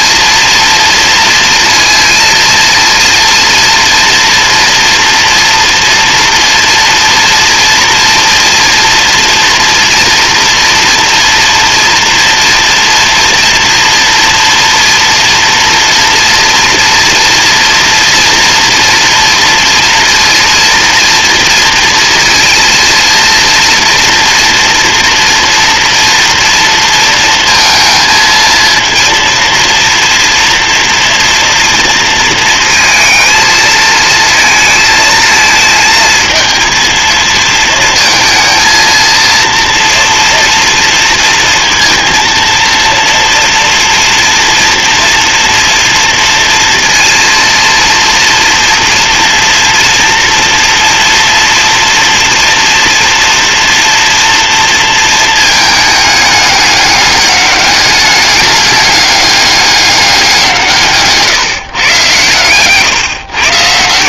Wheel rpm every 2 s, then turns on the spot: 230, 230, 230, 230, 230, 240, 230, 230, 230, 230, 230, 230, 230, 230, 230, 230, 230, 220, 220, 230, 230, 230, 230, 230, 240, 230, 240, 230, 200, 210, 160, 150.
none